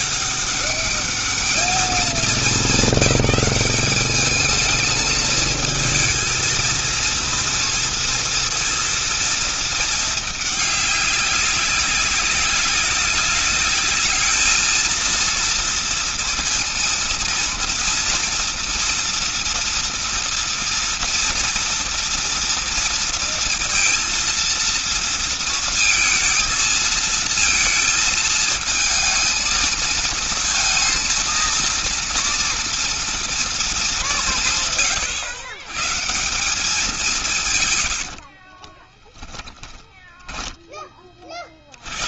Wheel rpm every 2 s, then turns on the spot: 200, 200, 210, 220, 230, 210, 200, 220, 230, 230, 230, 230, 230, 230, 220, 220, 230, 180, 160, 60, 10.
38-40